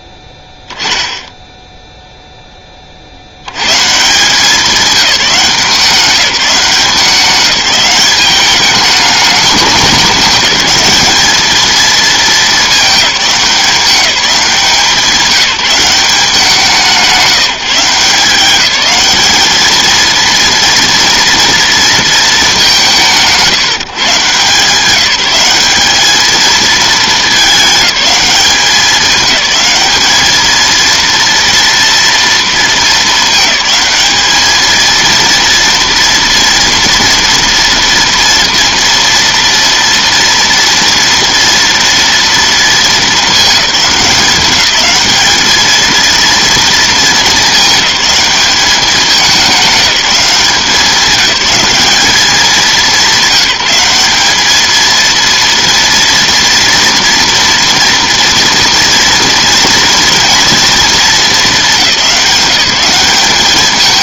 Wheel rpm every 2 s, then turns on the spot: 10, 40, 180, 190, 200, 210, 210, 190, 170, 190, 230, 170, 170, 220, 200, 230, 220, 220, 230, 240, 230, 220, 210, 220, 210, 200, 190, 230, 230, 230, 220, 180.
none